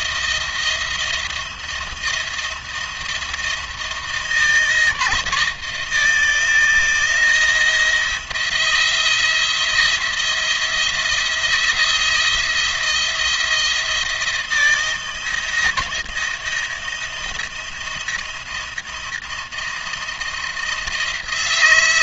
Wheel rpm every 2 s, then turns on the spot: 170, 170, 160, 160, 170, 170, 170, 160, 160, 160, 170.
none